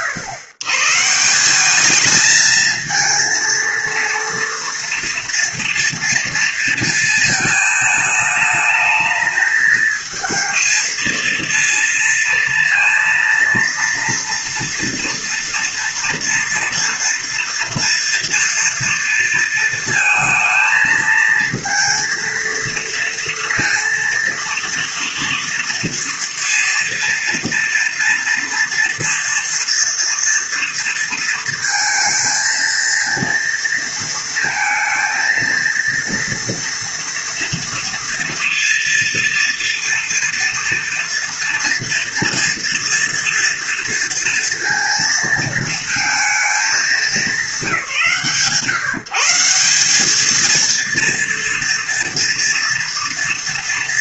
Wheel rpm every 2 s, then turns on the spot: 120, 220, 230, 230, 220, 220, 230, 230, 230, 230, 220, 230, 230, 230, 230, 230, 230, 230, 230, 230, 230, 230, 230, 210, 150, 230, 230.
none